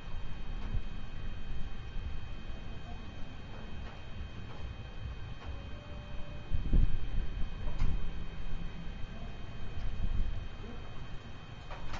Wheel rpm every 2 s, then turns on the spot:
0, 0, 0, 0, 0, 0.
none